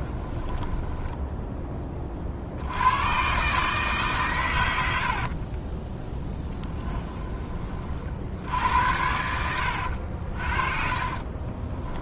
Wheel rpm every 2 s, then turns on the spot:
10, 70, 100, 10, 70, 40.
0-2 6-8 10-12